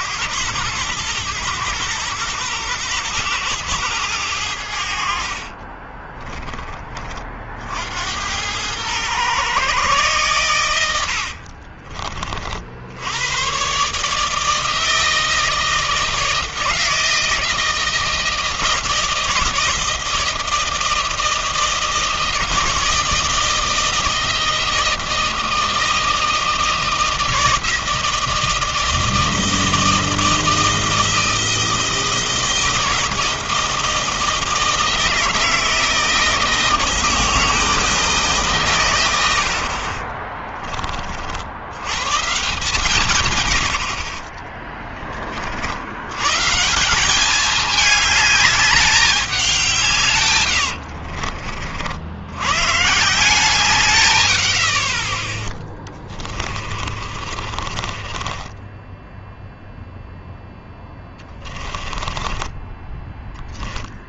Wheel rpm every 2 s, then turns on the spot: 110, 110, 60, 30, 110, 70, 80, 160, 160, 160, 160, 160, 160, 160, 160, 160, 160, 160, 160, 100, 40, 130, 30, 190, 190, 50, 150, 40, 40, 10, 10, 10.
4-6 10-12 50-52 56-62